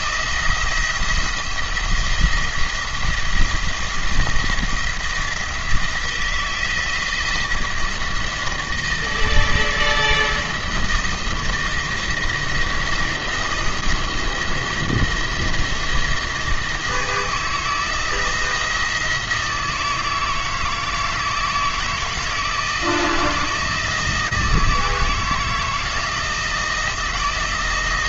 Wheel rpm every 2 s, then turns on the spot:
170, 170, 170, 170, 160, 170, 170, 170, 160, 170, 160, 160, 160, 170.
none